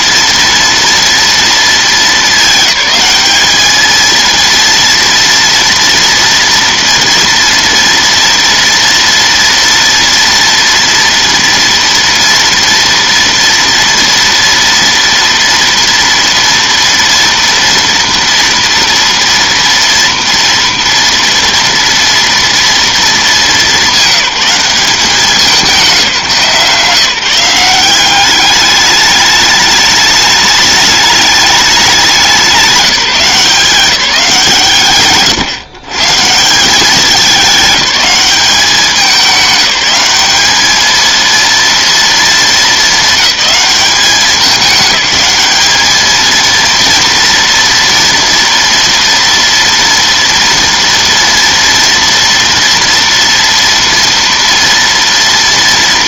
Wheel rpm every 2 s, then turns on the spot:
230, 210, 230, 230, 230, 230, 230, 230, 230, 230, 230, 230, 180, 170, 210, 210, 190, 150, 180, 200, 210, 220, 200, 230, 230, 230, 230, 230.
none